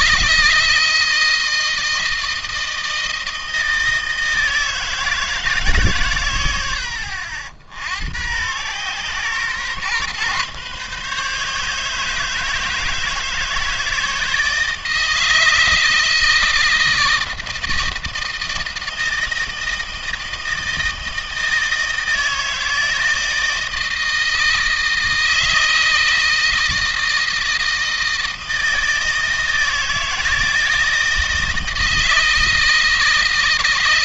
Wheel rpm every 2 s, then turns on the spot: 160, 160, 160, 80, 120, 140, 160, 160, 160, 160, 160, 160, 160, 160, 160, 160, 160.
none